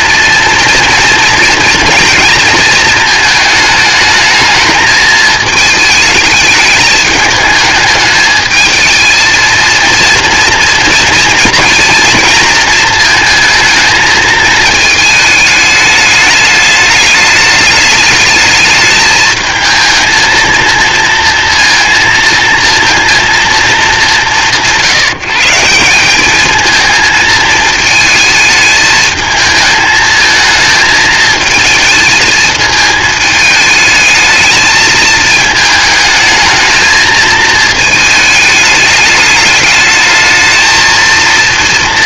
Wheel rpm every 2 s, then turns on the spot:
230, 230, 220, 210, 220, 240, 230, 220, 210, 220, 230, 230, 170, 220, 220, 220, 220, 220, 220, 210, 220.
none